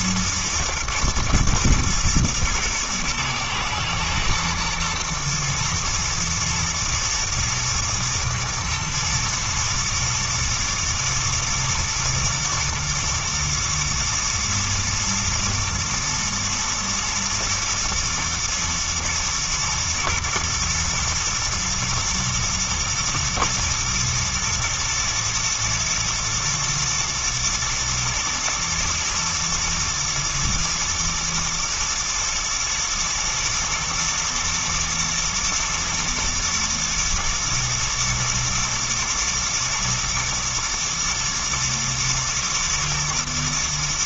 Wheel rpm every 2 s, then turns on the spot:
110, 110, 120, 110, 120, 120, 110, 120, 110, 110, 120, 120, 120, 110, 110, 120, 120, 120, 110, 110, 120, 110.
none